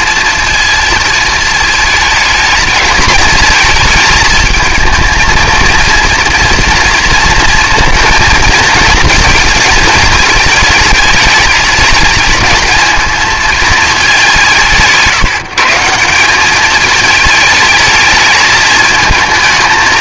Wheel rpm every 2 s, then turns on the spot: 220, 220, 220, 240, 230, 220, 220, 160, 210, 220.
none